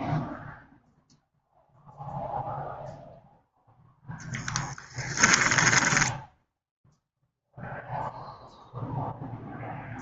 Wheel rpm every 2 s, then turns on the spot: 0, 0, 30, 0, 0.
4-6